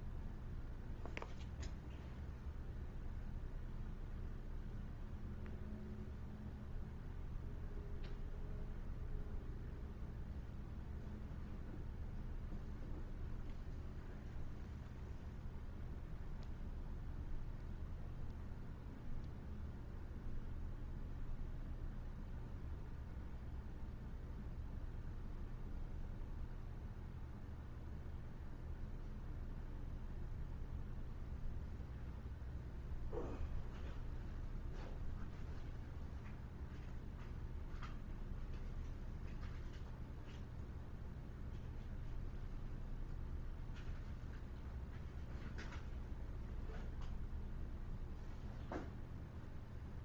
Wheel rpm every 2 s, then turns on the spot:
0, 0, 0, 0, 0, 0, 0, 0, 0, 0, 0, 0, 0, 0, 0, 0, 0, 0, 0, 0, 0, 0, 0, 0, 0.
none